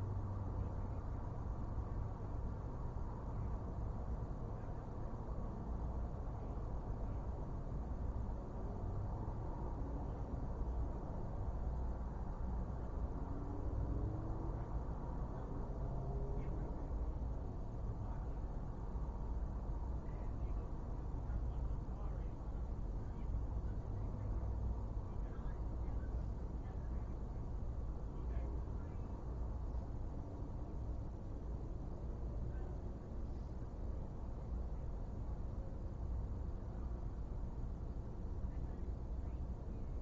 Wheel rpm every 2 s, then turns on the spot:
0, 0, 0, 0, 0, 0, 0, 0, 0, 0, 0, 0, 0, 0, 0, 0, 0, 0, 0, 0.
none